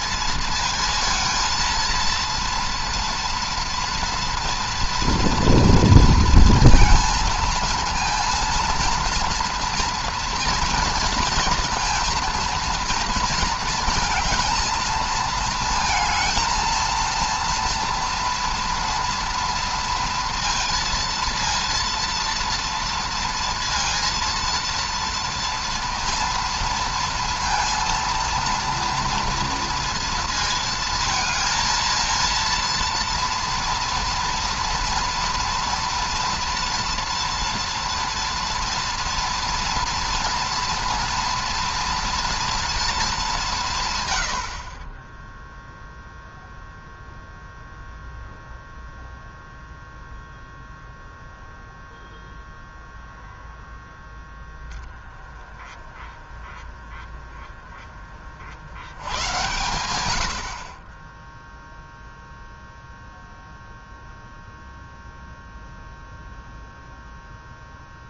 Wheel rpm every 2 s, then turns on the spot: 230, 230, 230, 230, 230, 230, 230, 220, 230, 230, 230, 230, 230, 230, 230, 220, 230, 230, 230, 230, 230, 220, 30, 0, 0, 0, 0, 10, 20, 90, 30, 0, 0, 0.
none